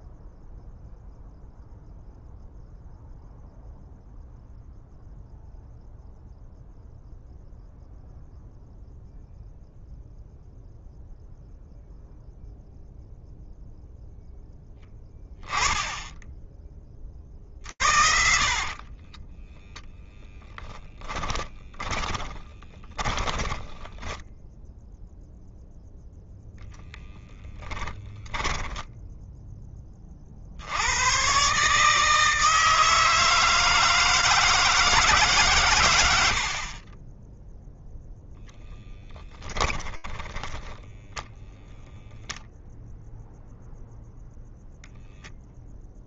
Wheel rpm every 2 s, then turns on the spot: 0, 0, 0, 0, 0, 0, 0, 0, 10, 30, 10, 20, 10, 0, 10, 90, 160, 160, 60, 0, 0, 0, 0.
18-24 36-38